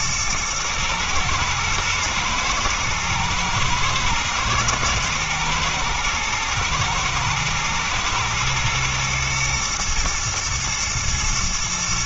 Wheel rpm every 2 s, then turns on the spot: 110, 110, 120, 110, 110, 120.
none